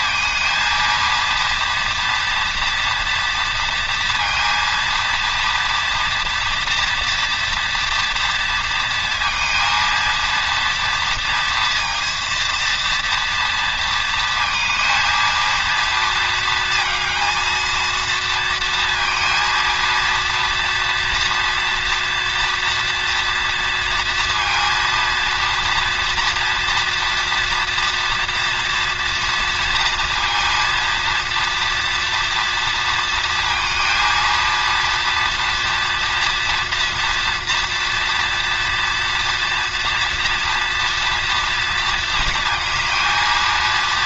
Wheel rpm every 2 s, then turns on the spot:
230, 230, 230, 230, 230, 230, 230, 220, 230, 230, 230, 230, 230, 230, 230, 230, 230, 230, 230, 230, 240, 230.
none